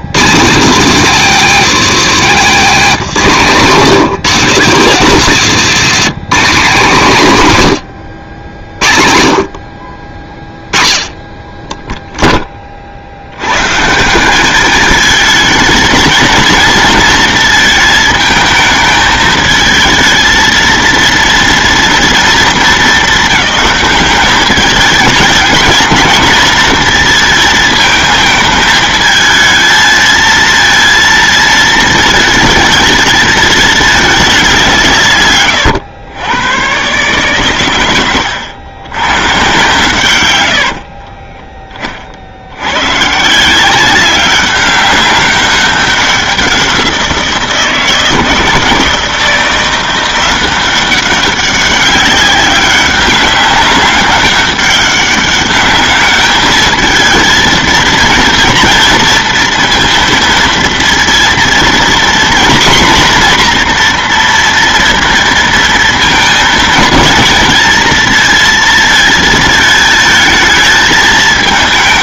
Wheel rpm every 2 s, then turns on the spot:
200, 200, 230, 200, 70, 20, 30, 210, 230, 220, 230, 220, 210, 220, 220, 230, 220, 180, 120, 100, 70, 90, 200, 180, 160, 190, 200, 200, 210, 230, 230, 250, 230, 230, 230, 220.
40-42